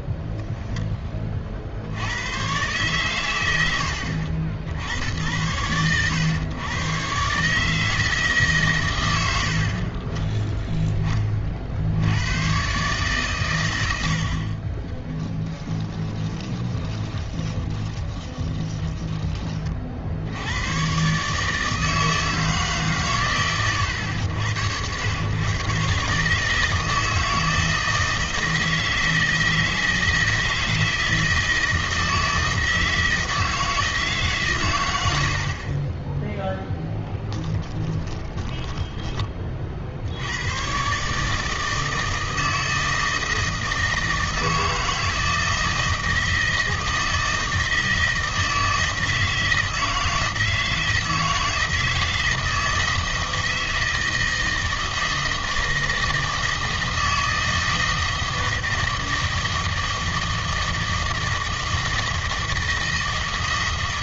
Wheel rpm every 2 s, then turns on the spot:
20, 120, 70, 120, 120, 10, 130, 20, 20, 20, 120, 140, 100, 160, 160, 160, 160, 120, 0, 20, 130, 160, 160, 160, 160, 160, 160, 160, 160, 160, 160, 160.
0-2 16-20 38-40